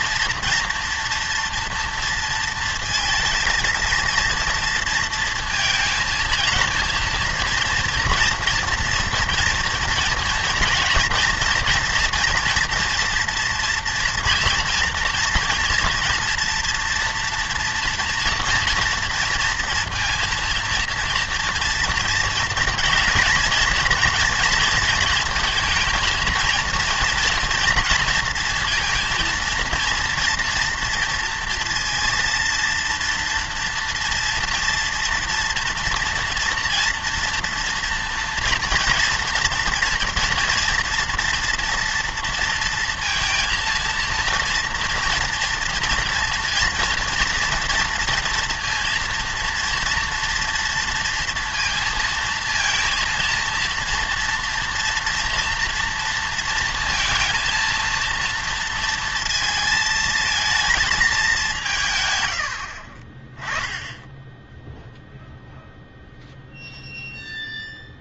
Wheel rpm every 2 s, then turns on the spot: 230, 230, 230, 230, 230, 230, 240, 230, 230, 230, 230, 230, 230, 230, 230, 230, 230, 230, 240, 230, 240, 230, 230, 230, 230, 230, 230, 240, 230, 230, 230, 70, 0, 0.
none